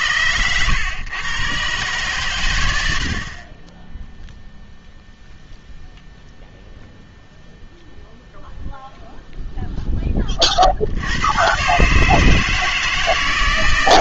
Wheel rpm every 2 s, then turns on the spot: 110, 100, 0, 0, 0, 50, 160.
none